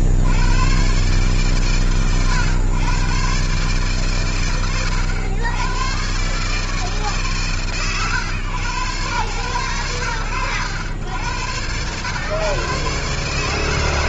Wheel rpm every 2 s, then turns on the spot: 70, 110, 100, 130, 110, 80, 120.
none